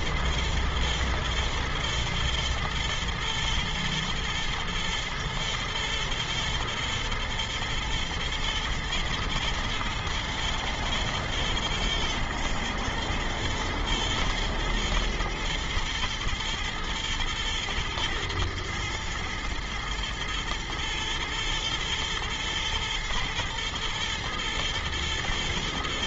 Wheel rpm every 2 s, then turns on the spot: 110, 120, 110, 110, 110, 120, 110, 120, 120, 110, 120, 120, 120.
none